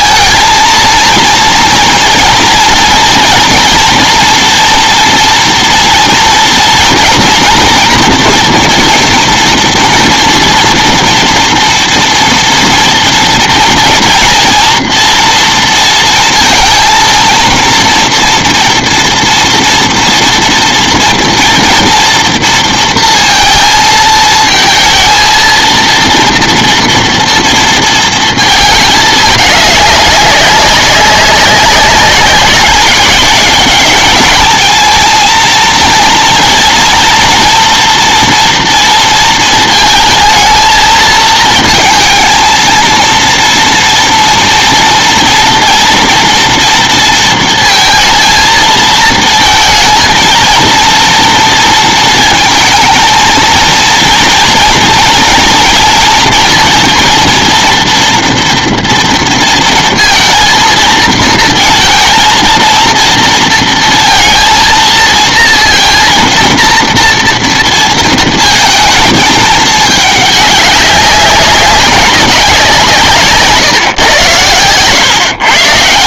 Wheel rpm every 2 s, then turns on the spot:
220, 230, 230, 230, 240, 230, 230, 230, 230, 240, 230, 230, 220, 230, 220, 200, 190, 220, 230, 230, 220, 230, 230, 230, 230, 230, 230, 240, 230, 230, 230, 230, 230, 230, 220, 200, 180, 110.
none